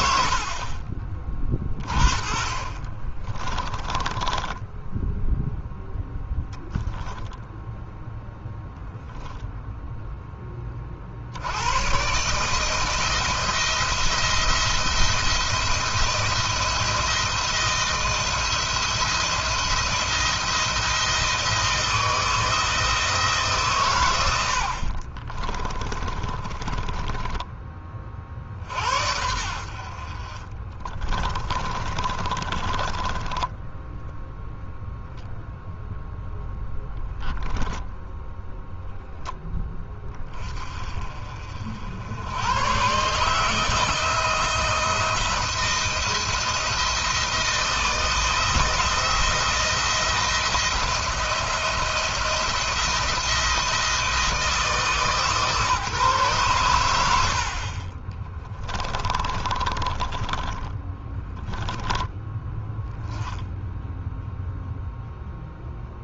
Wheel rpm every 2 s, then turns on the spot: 60, 30, 10, 10, 0, 50, 160, 170, 170, 170, 170, 160, 50, 20, 60, 30, 20, 0, 0, 0, 40, 130, 160, 160, 170, 170, 170, 150, 100, 20, 10, 10, 0.
0-4 24-28 30-34 58-62